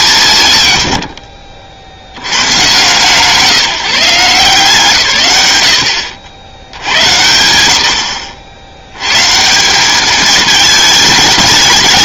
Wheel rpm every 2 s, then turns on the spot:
120, 120, 160, 90, 90, 220.
none